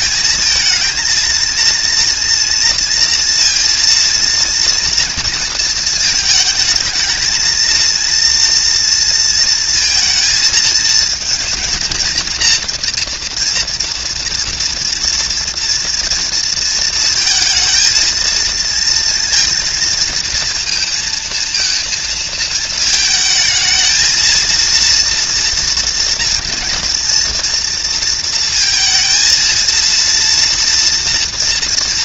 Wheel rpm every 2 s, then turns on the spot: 230, 230, 230, 220, 230, 230, 230, 230, 230, 230, 230, 220, 230, 230, 230, 230.
none